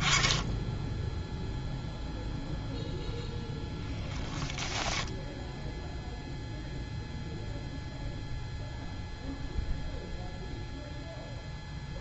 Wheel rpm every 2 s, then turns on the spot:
10, 0, 10, 0, 0, 0.
4-6